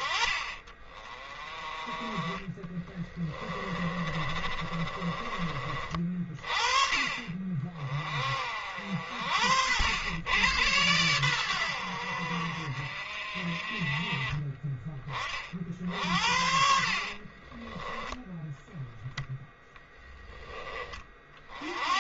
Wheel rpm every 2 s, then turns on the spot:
40, 20, 30, 40, 60, 100, 50, 30, 50, 10, 20.
2-6 16-18